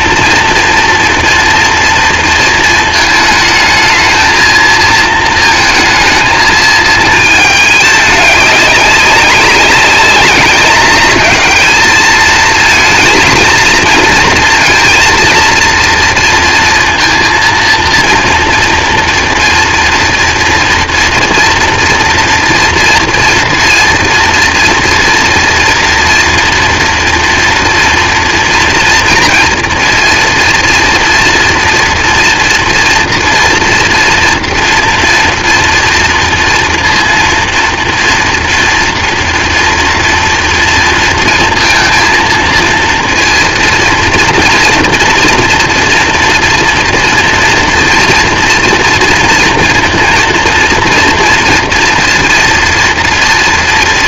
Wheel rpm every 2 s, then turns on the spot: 230, 220, 230, 220, 200, 210, 230, 230, 230, 230, 230, 230, 230, 230, 230, 230, 230, 230, 230, 230, 230, 230, 240, 230, 230, 230, 230.
none